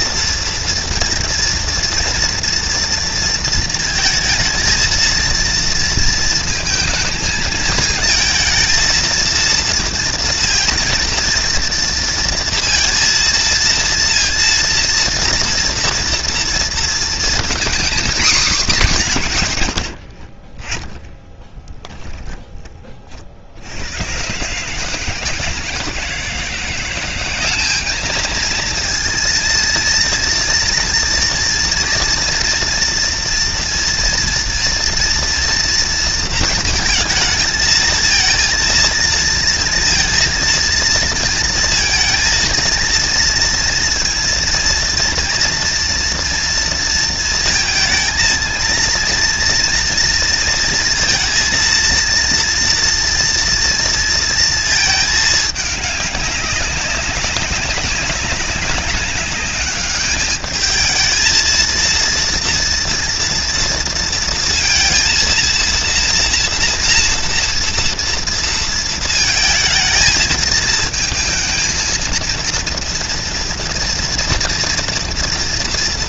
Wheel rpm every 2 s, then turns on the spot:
230, 230, 230, 220, 230, 230, 230, 230, 230, 220, 20, 40, 150, 180, 230, 230, 240, 230, 220, 230, 230, 230, 230, 230, 230, 230, 230, 220, 200, 200, 220, 230, 230, 230, 230, 220, 230, 230.
none